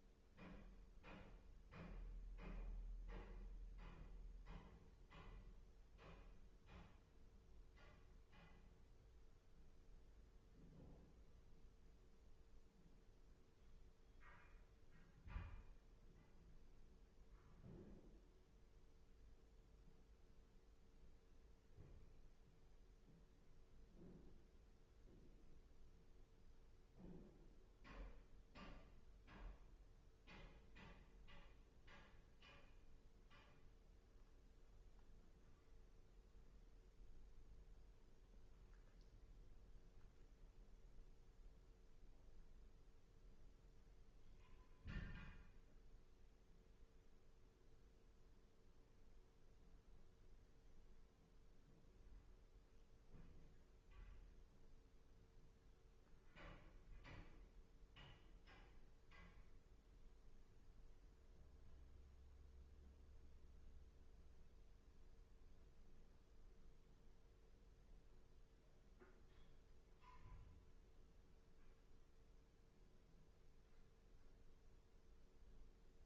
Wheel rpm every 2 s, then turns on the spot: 0, 0, 0, 0, 0, 0, 0, 0, 0, 0, 0, 0, 0, 0, 0, 0, 0, 0, 0, 0, 0, 0, 0, 0, 0, 0, 0, 0, 0, 0, 0, 0, 0, 0, 0, 0, 0, 0.
none